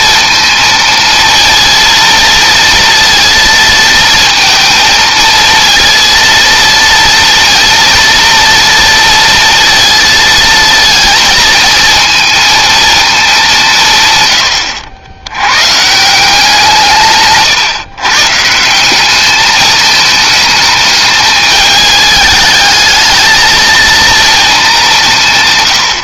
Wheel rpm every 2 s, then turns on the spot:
230, 230, 220, 230, 230, 230, 210, 90, 150, 210, 220, 220, 160.
none